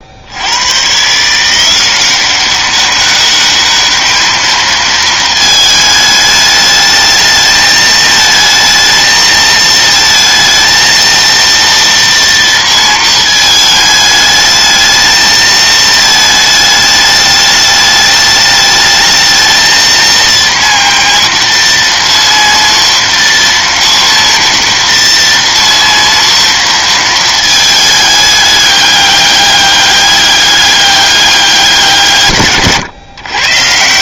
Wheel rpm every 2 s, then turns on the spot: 130, 200, 220, 220, 220, 230, 230, 220, 210, 220, 230, 230, 230, 230, 200, 200, 130.
none